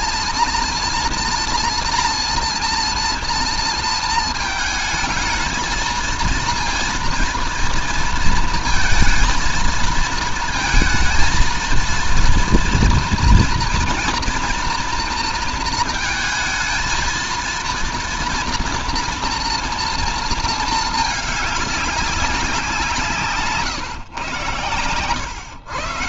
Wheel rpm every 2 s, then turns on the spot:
230, 230, 220, 230, 230, 230, 240, 230, 220, 230, 220, 170, 130.
none